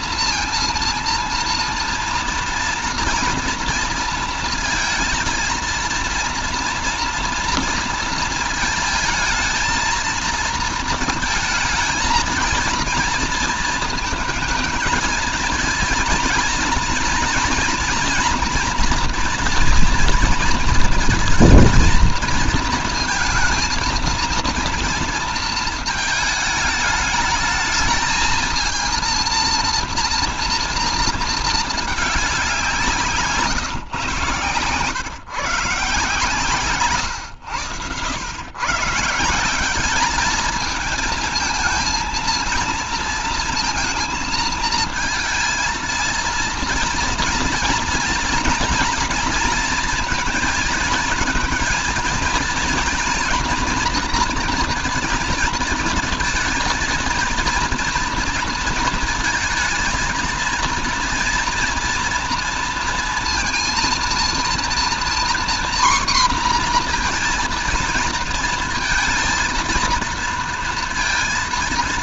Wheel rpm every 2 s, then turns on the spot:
230, 240, 230, 230, 220, 230, 230, 230, 230, 230, 230, 230, 230, 220, 230, 230, 180, 120, 140, 120, 220, 230, 230, 230, 230, 220, 240, 240, 230, 230, 230, 240, 240, 250, 230, 230.
none